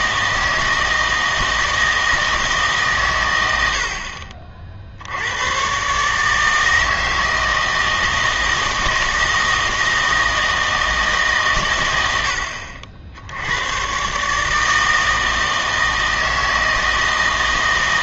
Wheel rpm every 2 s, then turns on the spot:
160, 140, 50, 160, 160, 160, 60, 160, 160.
none